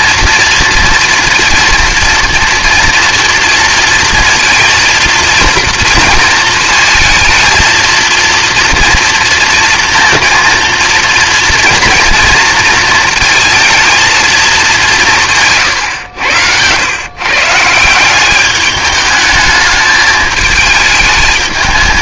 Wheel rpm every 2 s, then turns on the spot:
230, 240, 230, 220, 230, 230, 230, 190, 110, 210, 220.
none